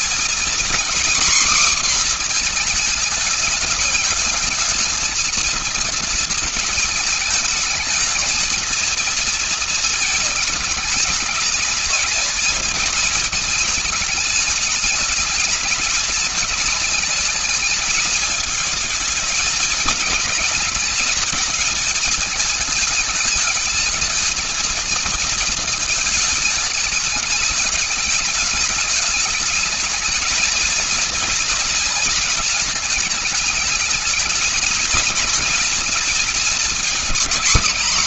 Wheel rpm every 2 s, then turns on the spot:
240, 230, 220, 220, 220, 220, 230, 210, 220, 220, 220, 210, 230, 210, 210, 220, 210, 230, 250.
none